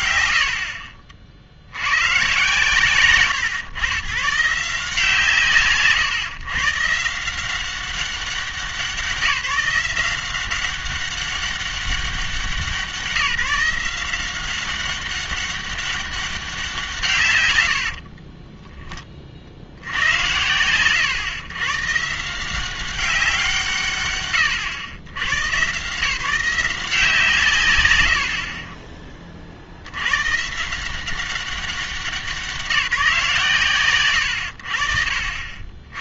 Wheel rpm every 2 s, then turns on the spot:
90, 130, 150, 130, 190, 190, 170, 190, 170, 10, 110, 180, 120, 170, 40, 160, 180, 80.
none